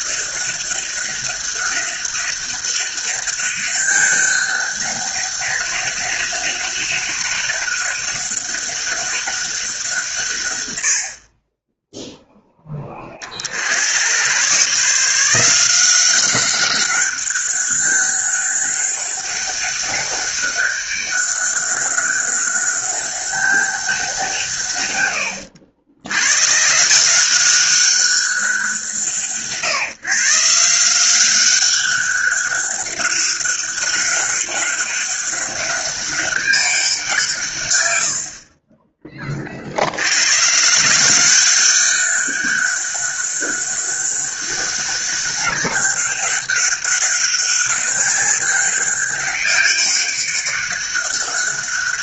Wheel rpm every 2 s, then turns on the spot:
200, 200, 200, 200, 200, 80, 20, 150, 200, 200, 200, 200, 110, 160, 180, 180, 200, 200, 180, 30, 170, 200, 200, 200, 200, 200.
none